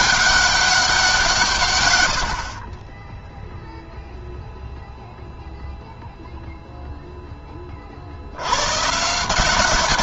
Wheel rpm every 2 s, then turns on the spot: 190, 40, 0, 0, 130.
none